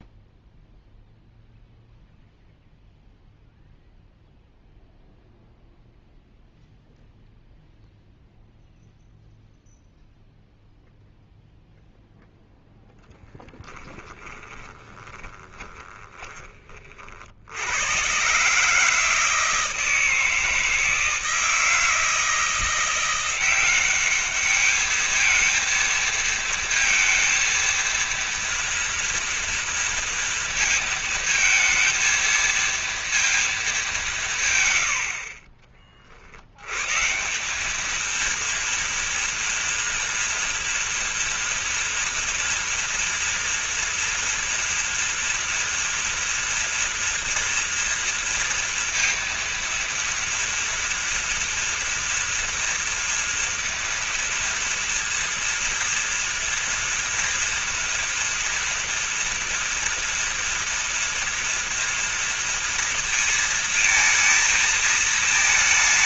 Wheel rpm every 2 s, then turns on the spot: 0, 0, 0, 0, 0, 0, 0, 20, 30, 150, 160, 170, 210, 230, 240, 230, 230, 110, 120, 230, 240, 230, 230, 230, 230, 230, 230, 230, 230, 230, 230, 230, 230.
14-16